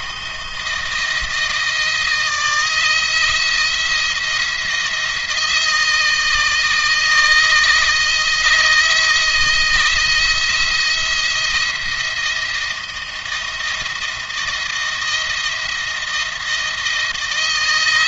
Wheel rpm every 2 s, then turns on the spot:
160, 160, 170, 160, 160, 170, 170, 170, 160.
none